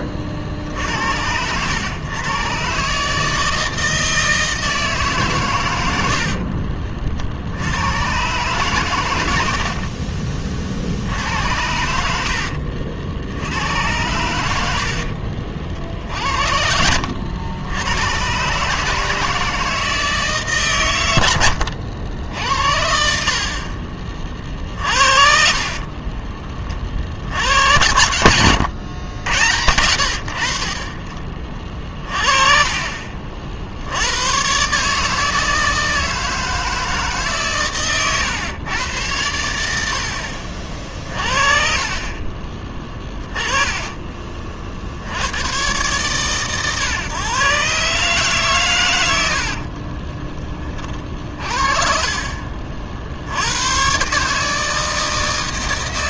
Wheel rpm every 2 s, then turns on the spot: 60, 130, 160, 40, 130, 50, 60, 90, 70, 140, 140, 80, 50, 40, 100, 50, 30, 130, 160, 120, 50, 30, 50, 130, 120, 30, 50, 150.
6-8 12-16 28-30